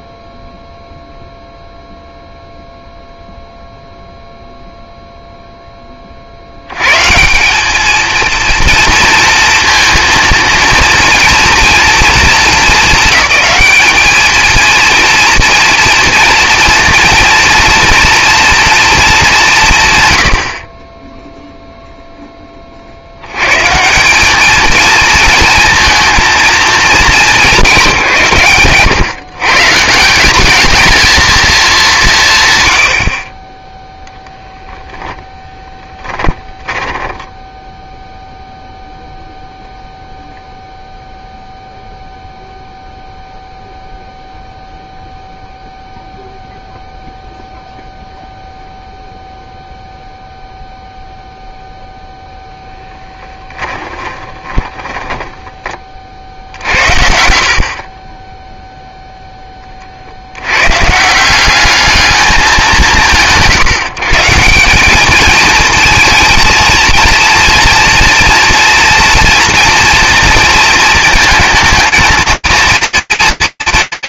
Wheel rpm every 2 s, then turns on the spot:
0, 0, 0, 80, 230, 230, 220, 230, 230, 230, 60, 30, 220, 220, 130, 210, 120, 10, 10, 0, 0, 0, 0, 0, 0, 0, 10, 10, 50, 0, 110, 200, 180, 230, 230, 230, 230.
36-38 52-56